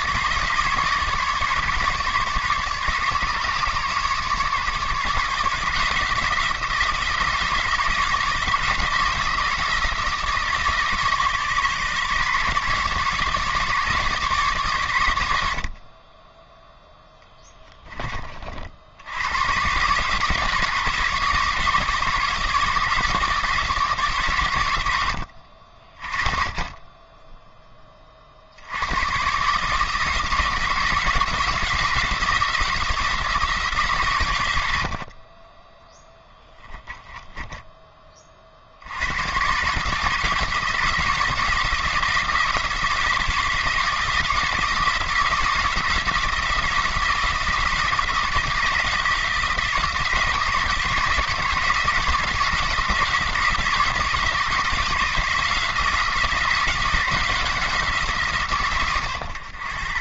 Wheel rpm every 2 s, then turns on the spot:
150, 150, 150, 160, 160, 160, 150, 130, 0, 70, 150, 150, 100, 20, 90, 170, 170, 80, 10, 60, 160, 160, 170, 170, 160, 160, 170, 160, 180, 130.
36-38